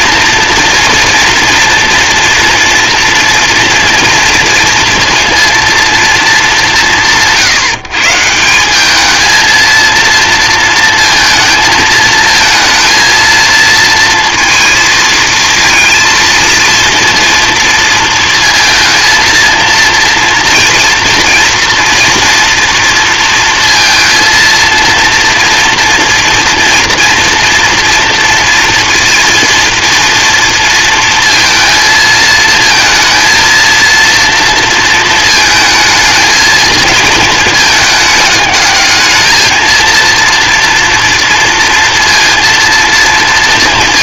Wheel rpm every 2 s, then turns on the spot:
230, 230, 230, 200, 180, 230, 230, 230, 230, 230, 240, 240, 230, 230, 230, 230, 220, 230, 220, 210, 230, 230.
none